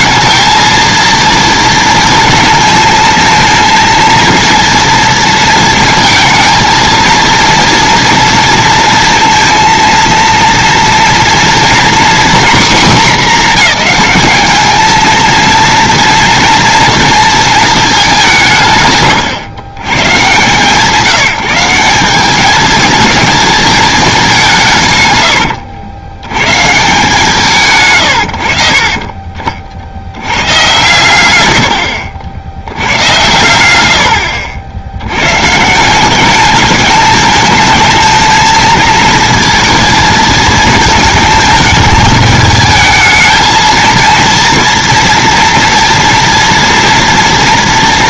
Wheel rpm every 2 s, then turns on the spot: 220, 220, 230, 220, 230, 230, 240, 210, 230, 160, 140, 210, 170, 130, 70, 110, 90, 70, 210, 220, 220, 210, 230, 230.
none